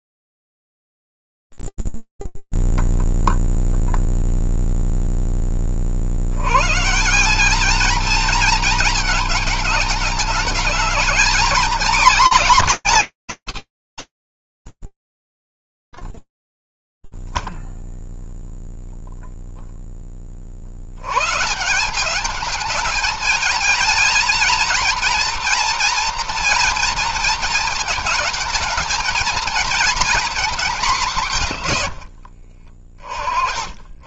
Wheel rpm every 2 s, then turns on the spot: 0, 0, 0, 110, 220, 220, 250, 100, 0, 0, 40, 200, 230, 230, 220, 220, 60.
none